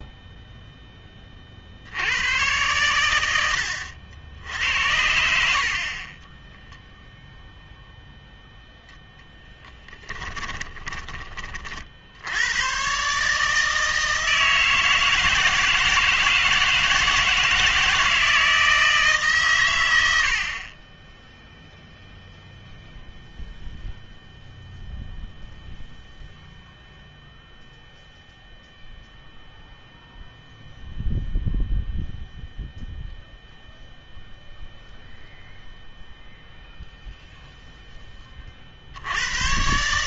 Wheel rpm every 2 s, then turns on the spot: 10, 110, 80, 0, 0, 20, 120, 160, 160, 160, 20, 0, 0, 0, 0, 0, 0, 0, 0, 60.
10-12